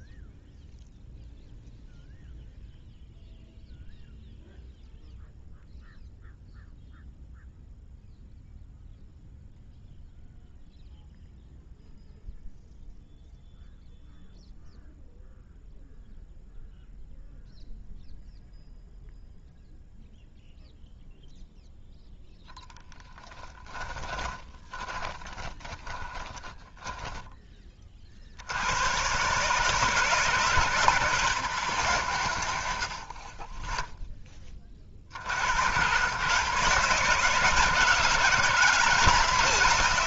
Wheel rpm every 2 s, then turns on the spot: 0, 0, 0, 0, 0, 0, 0, 0, 0, 0, 0, 10, 20, 10, 90, 150, 80, 30, 150, 160.
24-28